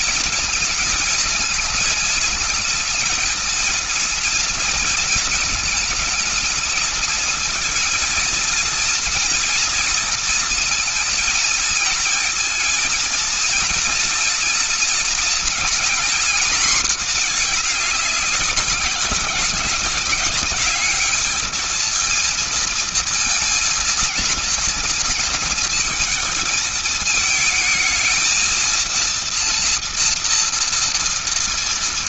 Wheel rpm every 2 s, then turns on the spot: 230, 230, 230, 220, 230, 230, 230, 230, 240, 200, 210, 230, 230, 220, 220, 230.
none